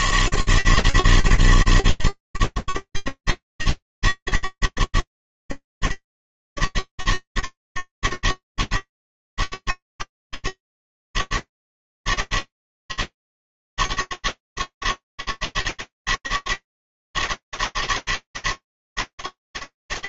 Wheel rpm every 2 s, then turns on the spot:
160, 150, 140, 120, 150, 130, 160, 160, 160, 160.
none